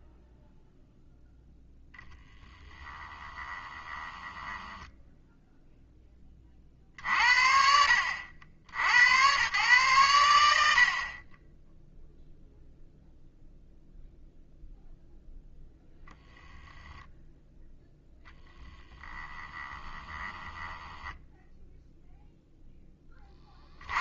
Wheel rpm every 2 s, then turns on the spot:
0, 10, 10, 50, 70, 70, 0, 0, 0, 10, 10, 10.
2-6 20-22